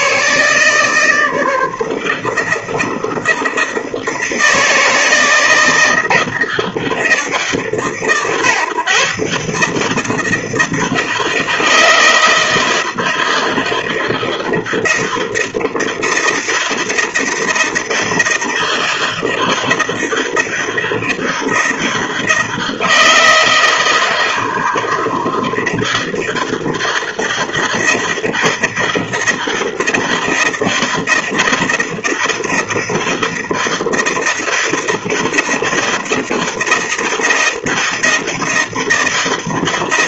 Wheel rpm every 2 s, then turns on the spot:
160, 160, 160, 160, 140, 160, 160, 160, 160, 160, 160, 160, 160, 160, 160, 160, 160, 160, 160, 160.
none